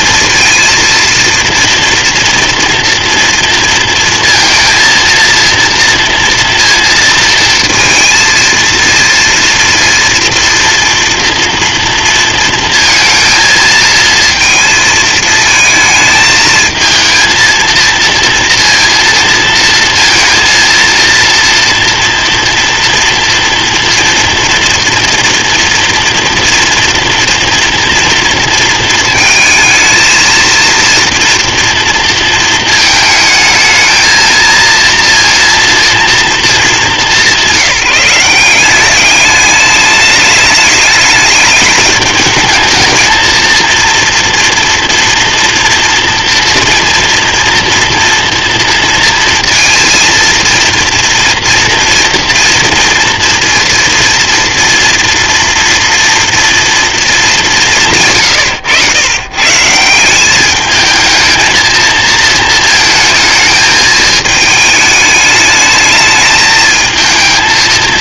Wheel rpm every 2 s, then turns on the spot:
230, 230, 230, 230, 230, 240, 230, 220, 220, 230, 230, 230, 230, 230, 230, 230, 220, 230, 200, 190, 210, 220, 240, 240, 230, 230, 240, 230, 230, 120, 210, 220, 210, 220.
none